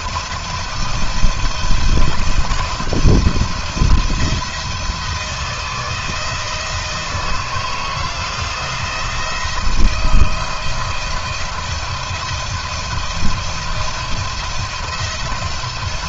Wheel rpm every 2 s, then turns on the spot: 170, 170, 170, 160, 170, 170, 170, 170.
none